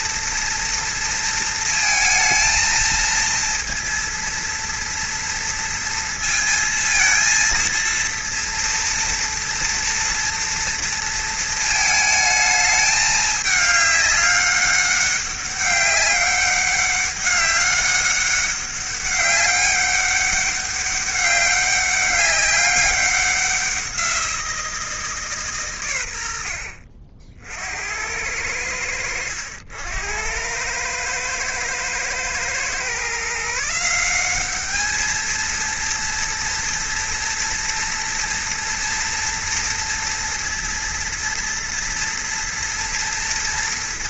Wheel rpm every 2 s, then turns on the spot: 230, 230, 230, 230, 230, 230, 210, 200, 200, 200, 200, 190, 170, 80, 90, 110, 130, 210, 230, 230, 230, 240.
none